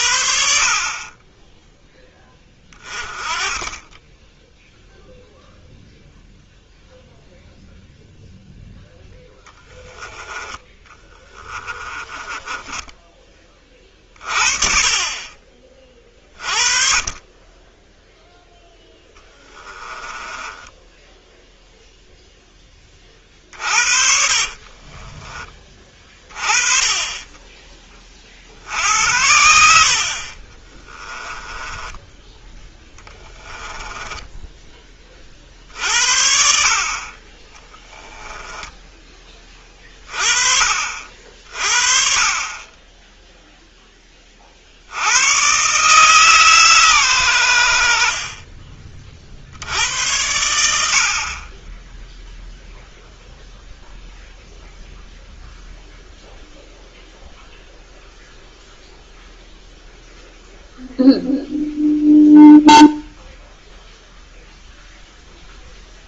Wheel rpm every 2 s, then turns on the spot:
40, 20, 0, 0, 0, 20, 10, 40, 40, 10, 10, 30, 30, 20, 70, 20, 10, 10, 70, 20, 40, 30, 40, 140, 30, 80, 0, 0, 0, 0, 0, 0, 0.
10-14 20-22 24-26 30-32 38-40